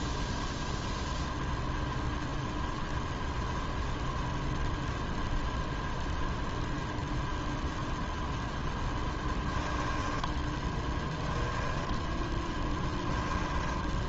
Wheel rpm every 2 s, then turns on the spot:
0, 0, 0, 0, 10, 0, 10.
12-14